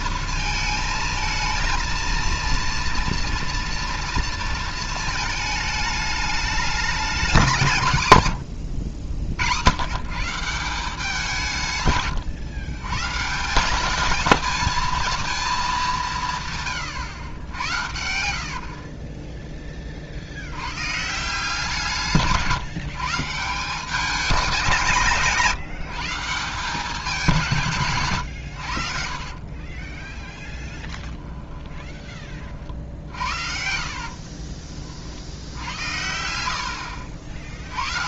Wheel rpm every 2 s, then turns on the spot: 230, 230, 230, 200, 70, 170, 130, 220, 120, 30, 130, 160, 160, 180, 60, 10, 50, 40, 80.
8-10 30-32